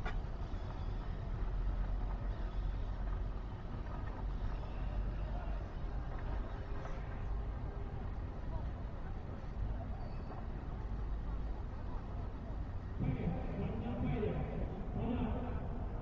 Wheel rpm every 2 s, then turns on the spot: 0, 0, 0, 0, 0, 0, 0, 0.
none